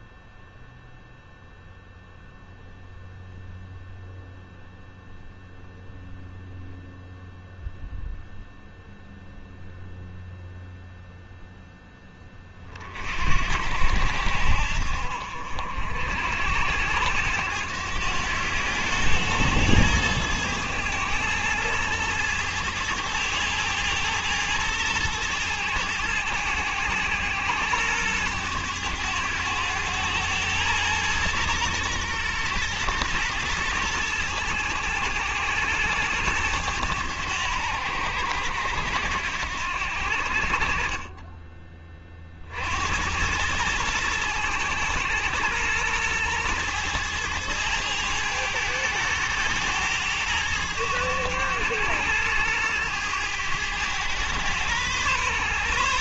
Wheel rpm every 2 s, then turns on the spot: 0, 0, 0, 0, 0, 0, 30, 60, 90, 100, 110, 110, 110, 100, 100, 110, 110, 110, 100, 80, 40, 60, 110, 110, 110, 100, 110, 120.
none